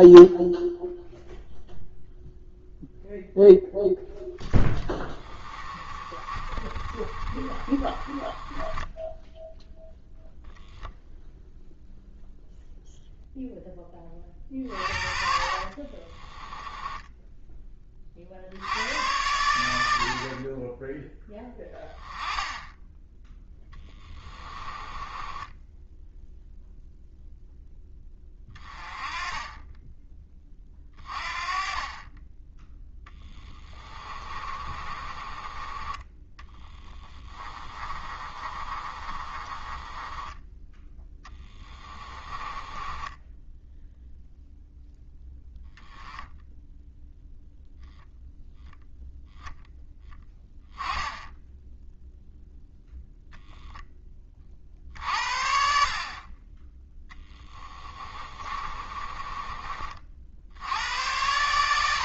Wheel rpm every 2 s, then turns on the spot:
0, 0, 20, 30, 10, 0, 0, 40, 10, 80, 20, 10, 20, 0, 20, 30, 10, 30, 10, 30, 10, 20, 0, 0, 0, 10, 0, 50, 10, 30, 90.
4-10 14-18 24-26 34-40 42-44 58-60